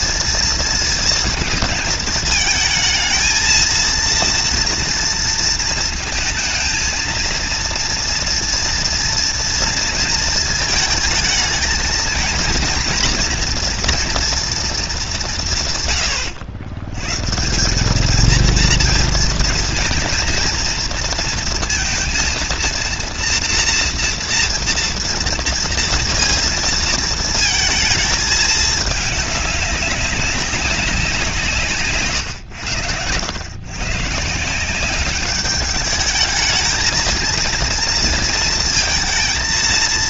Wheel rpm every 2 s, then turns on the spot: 230, 220, 230, 230, 230, 220, 230, 230, 110, 230, 230, 230, 230, 230, 210, 190, 110, 180, 220, 230.
none